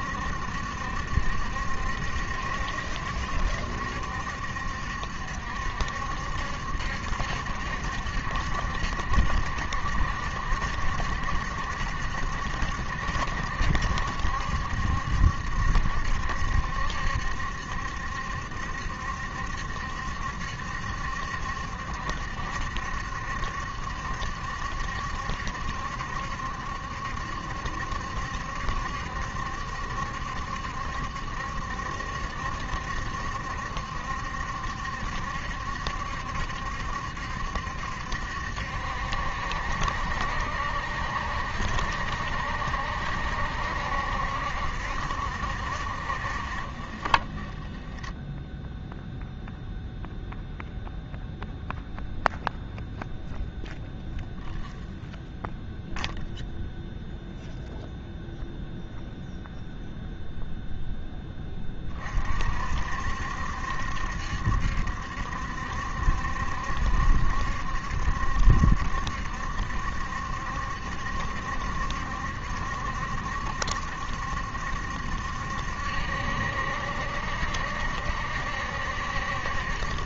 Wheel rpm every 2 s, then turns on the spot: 70, 70, 70, 70, 70, 70, 70, 70, 70, 70, 70, 70, 70, 70, 70, 70, 70, 70, 70, 70, 70, 70, 60, 30, 0, 0, 0, 0, 0, 0, 0, 60, 70, 70, 70, 70, 70, 70, 70, 70.
none